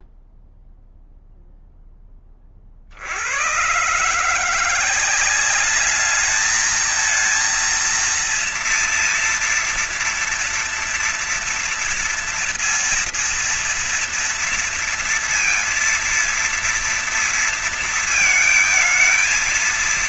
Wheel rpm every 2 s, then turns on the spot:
0, 20, 160, 210, 230, 230, 230, 230, 230, 220.
none